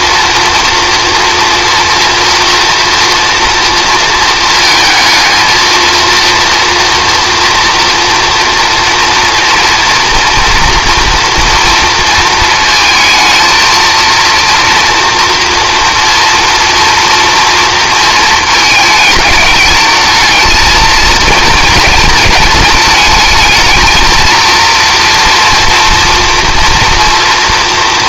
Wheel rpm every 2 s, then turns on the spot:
230, 230, 220, 230, 230, 240, 220, 230, 240, 210, 220, 220, 230, 230.
none